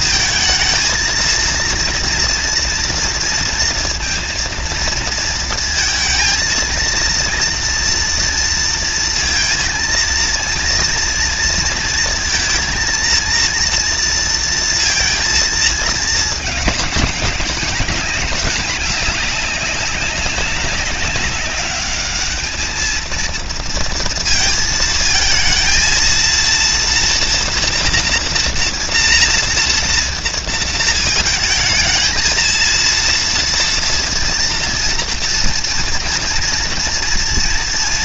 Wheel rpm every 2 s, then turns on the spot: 230, 230, 230, 230, 240, 230, 230, 230, 230, 200, 200, 200, 230, 220, 240, 230, 220, 230, 230.
none